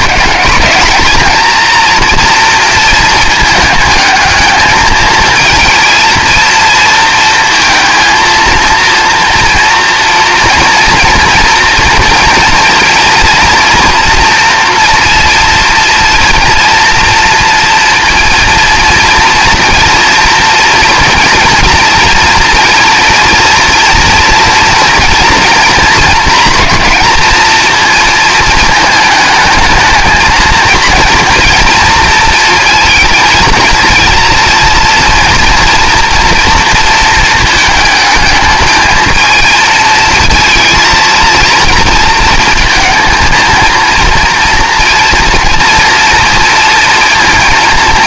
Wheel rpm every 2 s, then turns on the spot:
230, 230, 220, 230, 230, 230, 230, 240, 240, 230, 240, 240, 240, 240, 220, 230, 220, 230, 230, 220, 230, 230, 230, 230.
none